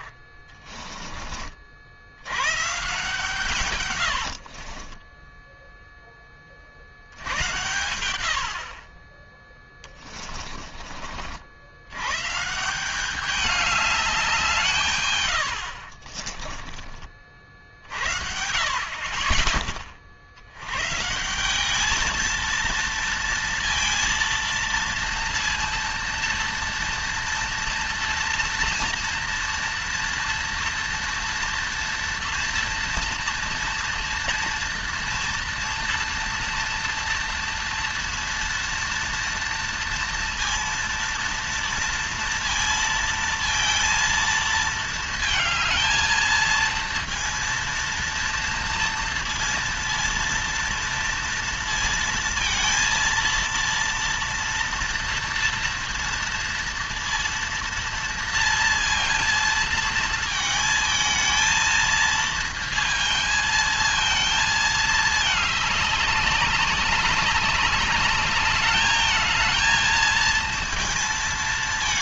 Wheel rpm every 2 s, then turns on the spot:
30, 100, 70, 30, 70, 20, 150, 170, 20, 50, 70, 230, 230, 230, 230, 230, 230, 230, 230, 230, 230, 230, 230, 230, 230, 230, 230, 230, 230, 230, 220, 230, 220, 190, 210, 230.
0-2 4-6 16-18